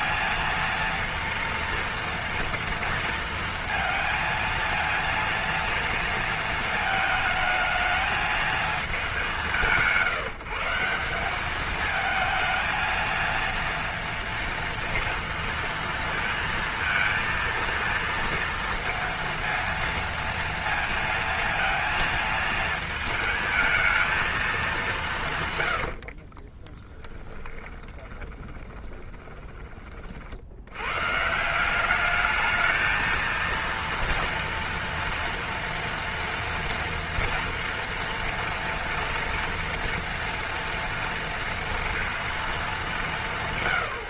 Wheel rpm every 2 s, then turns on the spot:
230, 230, 230, 220, 220, 160, 230, 230, 230, 230, 230, 220, 210, 20, 20, 80, 220, 230, 230, 230, 230, 220.
26-30